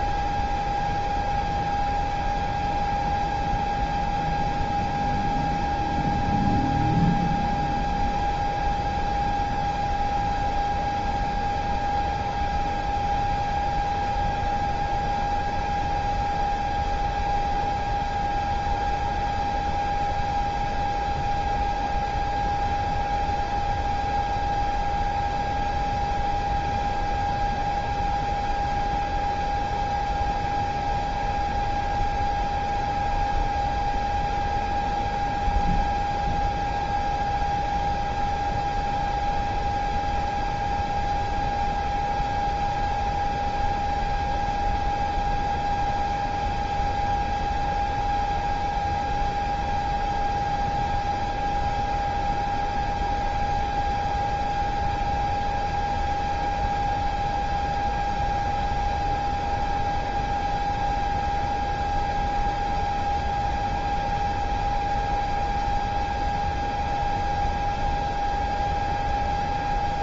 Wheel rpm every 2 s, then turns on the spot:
0, 0, 0, 0, 0, 0, 0, 0, 0, 0, 0, 0, 0, 0, 0, 0, 0, 0, 0, 0, 0, 0, 0, 0, 0, 0, 0, 0, 0, 0, 0, 0, 0, 0, 0.
none